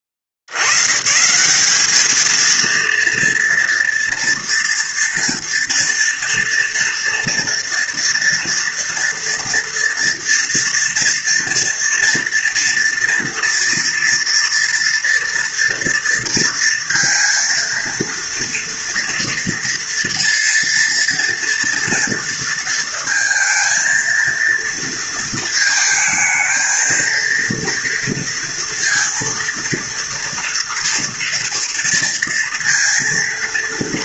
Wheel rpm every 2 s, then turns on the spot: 60, 230, 230, 230, 230, 230, 230, 230, 230, 230, 230, 230, 230, 220, 230, 230, 230.
none